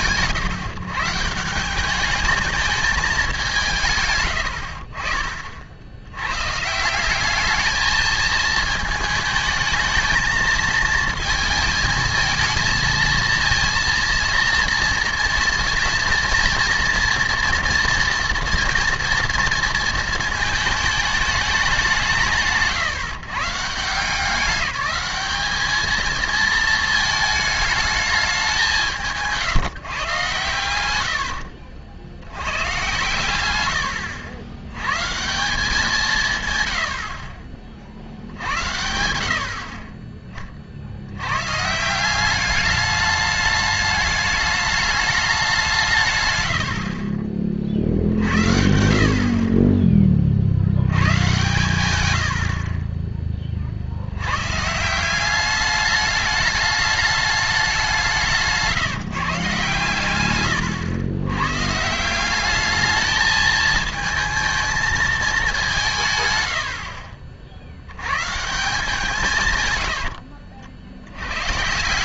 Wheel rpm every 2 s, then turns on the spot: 150, 210, 60, 140, 220, 230, 230, 230, 230, 230, 220, 150, 200, 220, 180, 100, 110, 100, 120, 70, 60, 210, 210, 80, 60, 80, 50, 140, 210, 160, 110, 210, 220, 90, 170, 60.
none